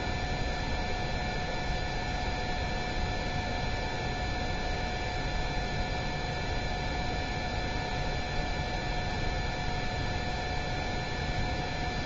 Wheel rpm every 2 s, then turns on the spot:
0, 0, 0, 0, 0, 0.
none